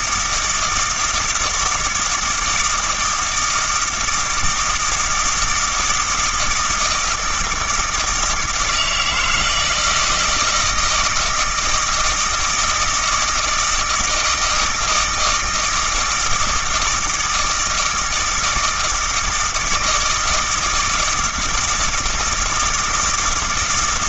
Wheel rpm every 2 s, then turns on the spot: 160, 160, 160, 160, 160, 160, 160, 160, 160, 160, 160, 160.
none